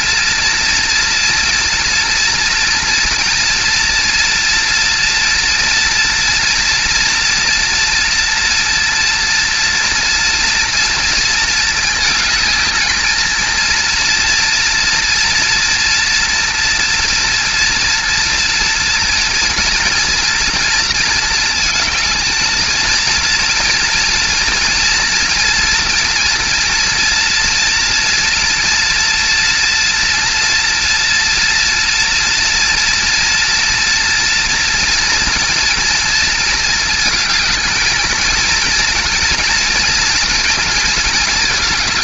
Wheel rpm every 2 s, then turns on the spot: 230, 230, 230, 240, 230, 230, 220, 230, 230, 230, 230, 220, 230, 230, 230, 230, 230, 230, 230, 230, 230.
none